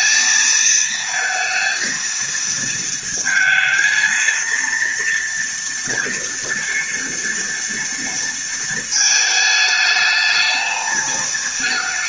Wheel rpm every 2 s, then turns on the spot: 220, 230, 230, 240, 220, 220.
none